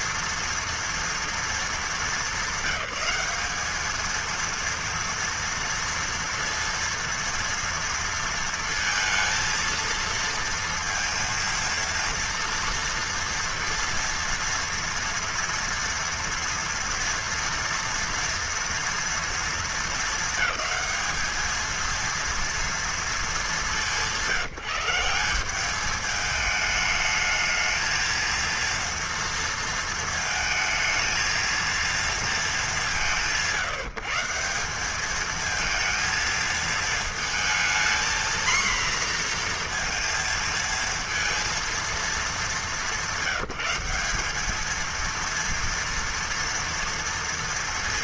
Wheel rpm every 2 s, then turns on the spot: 230, 210, 230, 230, 230, 230, 230, 230, 230, 220, 230, 170, 210, 230, 220, 200, 170, 230, 240, 230, 220, 200, 230, 190.
none